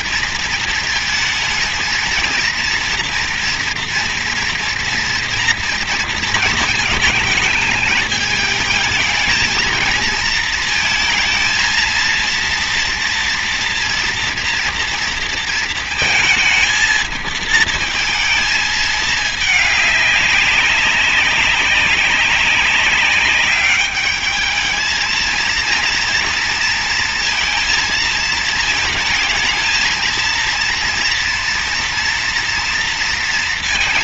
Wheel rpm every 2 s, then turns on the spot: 220, 230, 230, 220, 220, 220, 230, 230, 220, 220, 200, 200, 220, 230, 220, 230, 230.
none